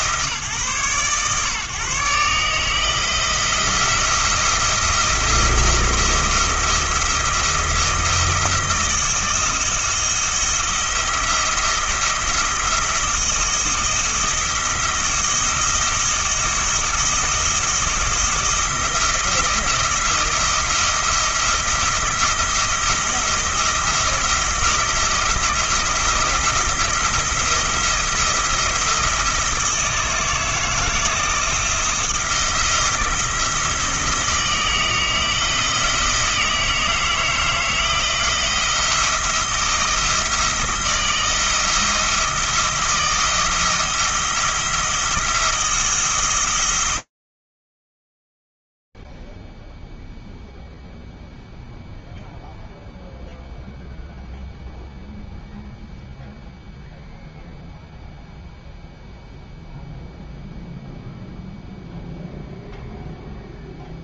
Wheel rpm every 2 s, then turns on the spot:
140, 160, 170, 170, 160, 170, 170, 170, 160, 170, 170, 170, 170, 170, 170, 160, 170, 160, 160, 170, 170, 170, 170, 120, 0, 0, 0, 0, 0, 0, 0, 0.
none